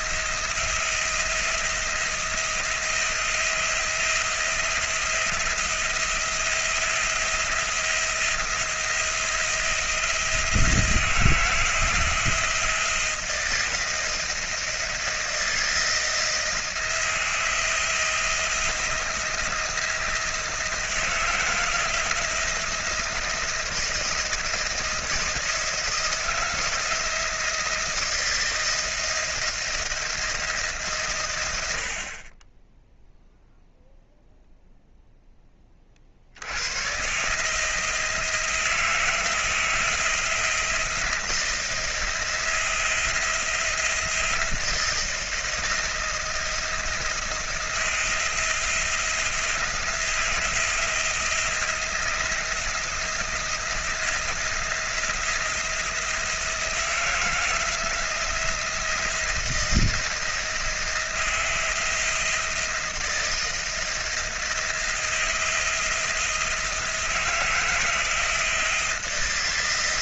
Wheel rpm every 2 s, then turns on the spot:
170, 170, 170, 170, 170, 160, 170, 170, 170, 170, 160, 170, 170, 170, 170, 150, 10, 0, 120, 170, 170, 170, 160, 170, 170, 160, 170, 170, 170, 170, 170, 170, 170, 160, 170.
none